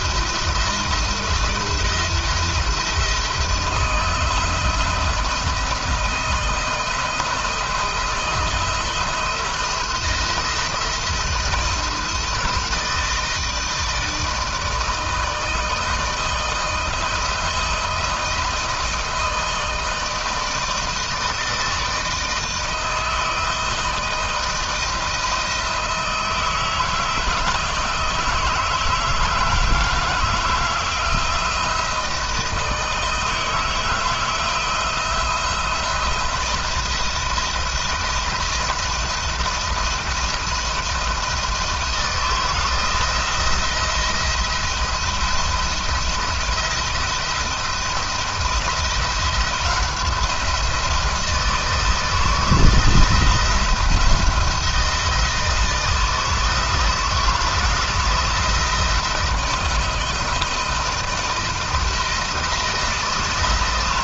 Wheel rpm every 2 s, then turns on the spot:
170, 170, 170, 170, 170, 170, 160, 160, 160, 160, 160, 160, 160, 160, 160, 160, 160, 170, 160, 170, 170, 160, 170, 160, 170, 170, 160, 170, 160, 170, 160, 160.
none